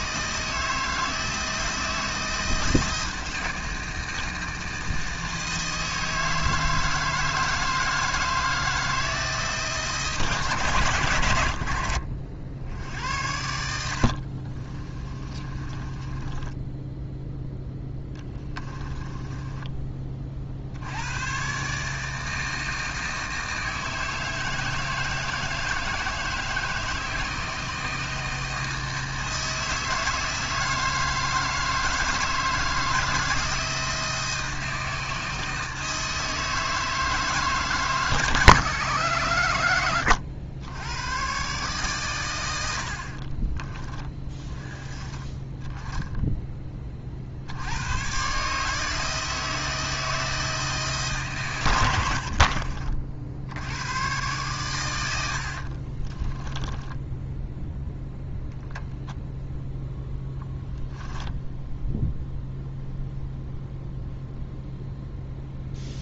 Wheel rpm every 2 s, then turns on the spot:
160, 160, 160, 160, 160, 130, 70, 40, 10, 20, 70, 160, 160, 160, 160, 160, 160, 160, 160, 140, 100, 80, 20, 20, 150, 160, 50, 110, 10, 0, 10, 0, 0.
14-20 52-54 56-58 60-62